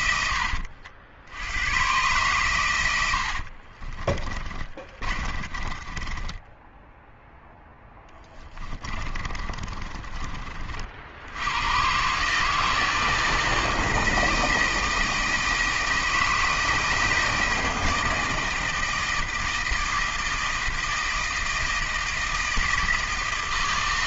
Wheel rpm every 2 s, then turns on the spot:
80, 110, 30, 10, 30, 50, 160, 160, 160, 160, 160, 160.
4-6 8-10